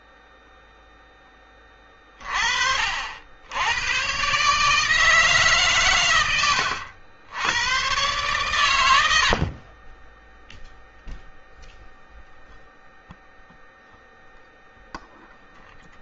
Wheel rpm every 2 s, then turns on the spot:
0, 60, 150, 90, 100, 0, 0, 0.
8-10